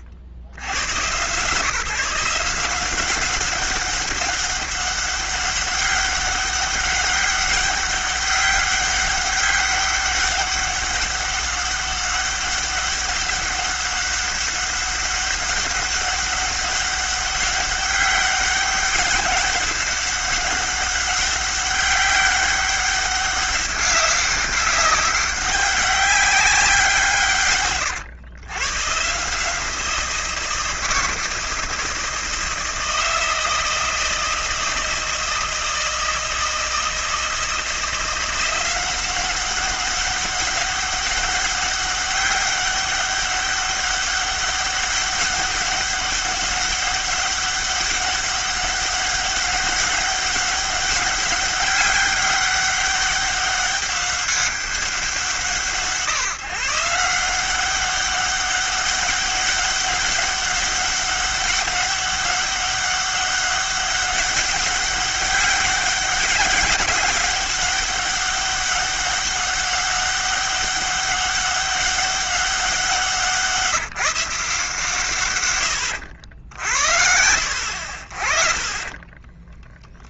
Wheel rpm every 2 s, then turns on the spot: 70, 180, 200, 190, 200, 200, 200, 200, 200, 200, 200, 200, 190, 180, 120, 170, 160, 160, 160, 180, 200, 200, 200, 200, 200, 200, 200, 180, 150, 200, 200, 200, 200, 200, 200, 200, 190, 150, 70, 20.
none